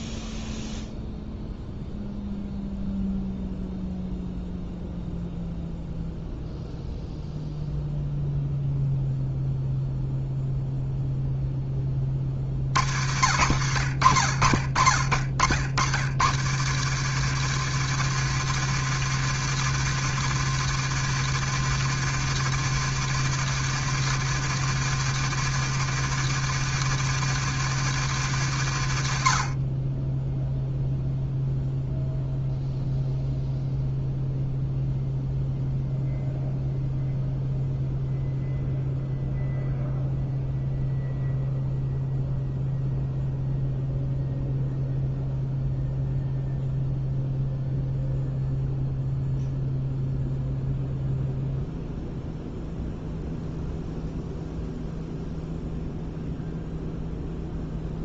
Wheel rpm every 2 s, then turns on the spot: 0, 0, 0, 0, 0, 0, 70, 60, 150, 160, 160, 160, 160, 160, 90, 0, 0, 0, 0, 0, 0, 0, 0, 0, 0, 0, 0, 0, 0.
none